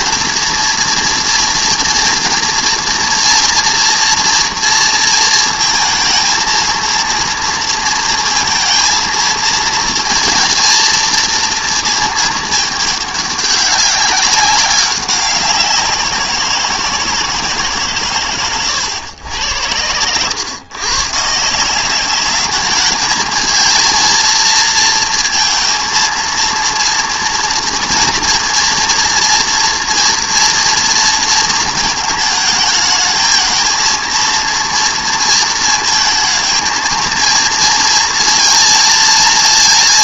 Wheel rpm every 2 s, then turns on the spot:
230, 230, 230, 230, 230, 230, 210, 200, 170, 110, 110, 210, 230, 230, 230, 230, 220, 230, 220, 230.
none